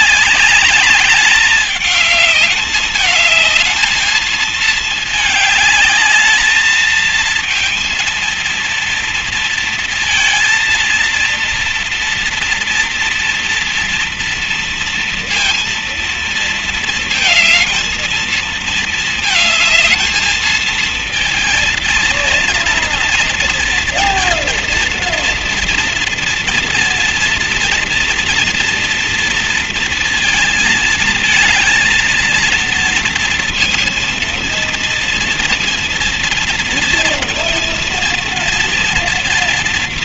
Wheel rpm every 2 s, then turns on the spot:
200, 220, 210, 230, 230, 230, 230, 230, 230, 220, 230, 230, 230, 230, 230, 230, 230, 230, 230, 240.
none